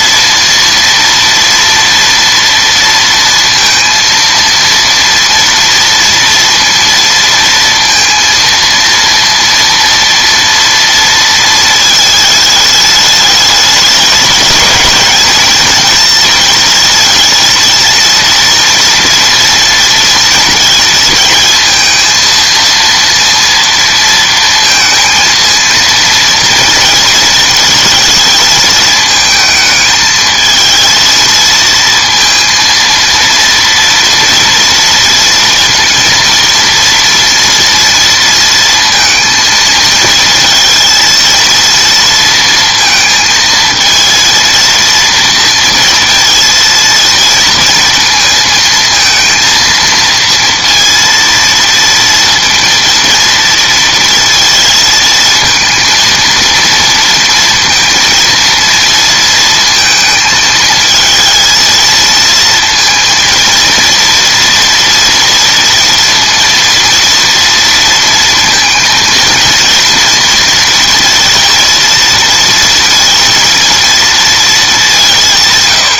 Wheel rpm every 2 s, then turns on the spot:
230, 230, 230, 230, 230, 230, 210, 210, 230, 230, 230, 230, 230, 230, 220, 220, 230, 230, 230, 230, 230, 230, 230, 230, 230, 230, 230, 230, 230, 230, 220, 230, 240, 230, 230, 230, 230, 200.
none